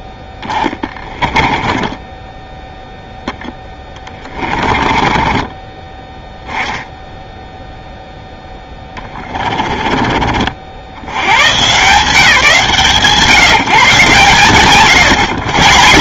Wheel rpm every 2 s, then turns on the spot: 10, 0, 20, 10, 10, 90, 150, 110.
0-2 4-6 8-10